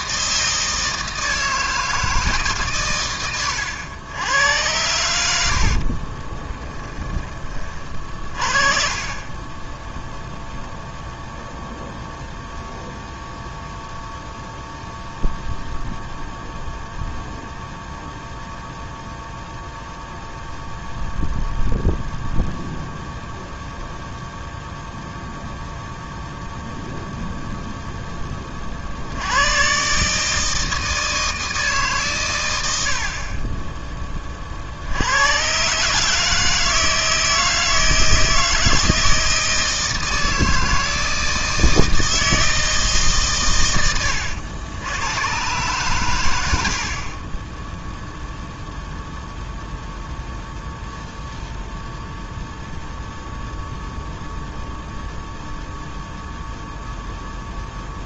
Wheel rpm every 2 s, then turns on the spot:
160, 130, 80, 10, 40, 0, 0, 0, 0, 0, 0, 0, 0, 0, 60, 160, 70, 70, 160, 160, 160, 150, 100, 50, 0, 0, 0, 0, 0.
none